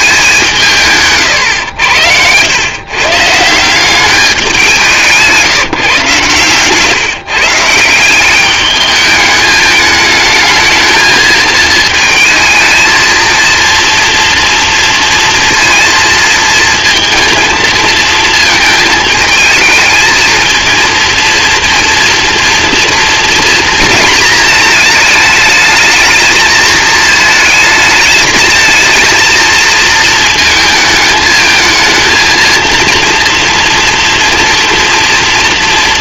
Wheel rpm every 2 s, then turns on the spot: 190, 110, 190, 130, 210, 220, 220, 230, 230, 220, 220, 230, 220, 220, 220, 220, 230, 230.
none